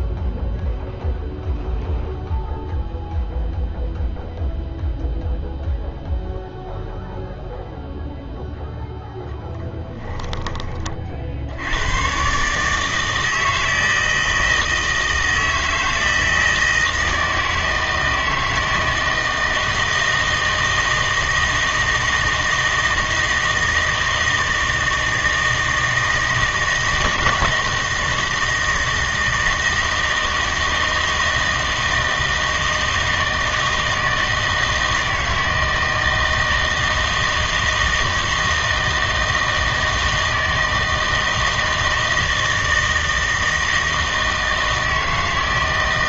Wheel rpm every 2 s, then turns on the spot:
0, 0, 0, 0, 0, 30, 150, 160, 160, 160, 160, 160, 160, 160, 160, 160, 160, 160, 160, 160, 160, 160, 160.
none